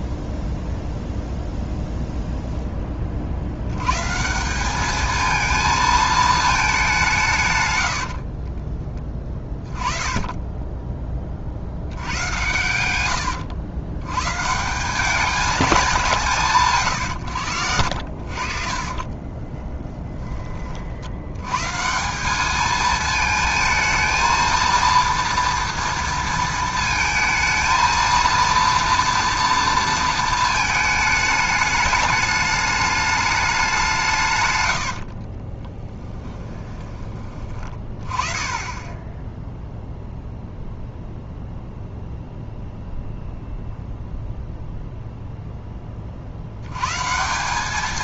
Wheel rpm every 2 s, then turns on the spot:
0, 10, 190, 210, 40, 10, 100, 160, 150, 50, 30, 210, 230, 230, 230, 220, 210, 100, 20, 20, 0, 0, 0, 90.
8-10 12-14 18-20 34-38